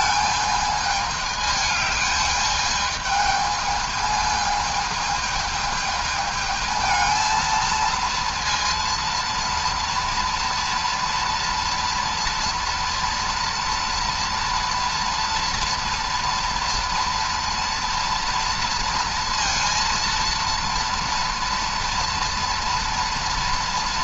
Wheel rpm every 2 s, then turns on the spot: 210, 210, 220, 220, 230, 240, 230, 230, 230, 230, 230, 230.
none